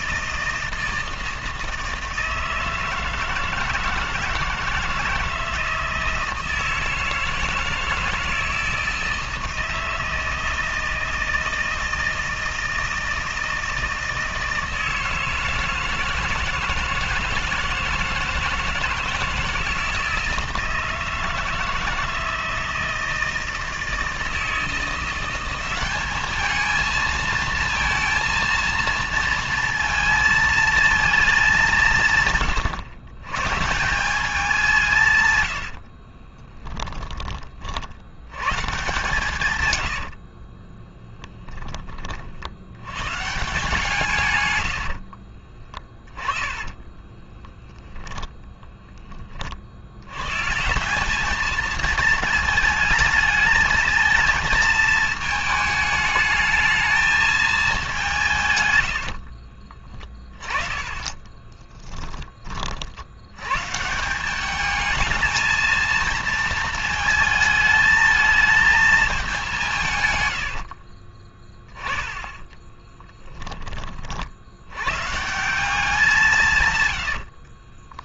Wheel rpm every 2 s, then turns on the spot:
160, 160, 160, 160, 160, 160, 160, 160, 160, 160, 160, 160, 170, 220, 230, 230, 120, 170, 10, 150, 20, 80, 100, 20, 10, 180, 220, 220, 220, 110, 20, 40, 210, 220, 220, 60, 10, 90, 140.
36-38 40-42 46-48 60-62 70-74